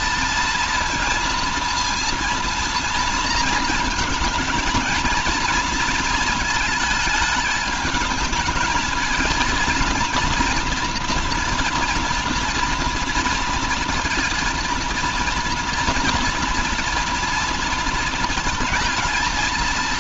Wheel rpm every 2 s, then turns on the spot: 230, 230, 230, 220, 220, 240, 230, 230, 230, 220.
none